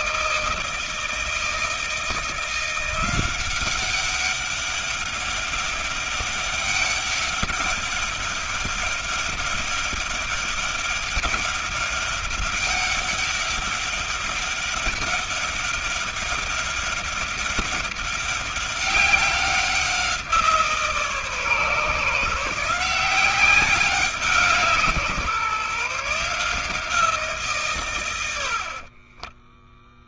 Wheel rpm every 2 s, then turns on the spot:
160, 170, 200, 200, 200, 200, 200, 190, 200, 200, 160, 170, 170, 160, 60.
28-30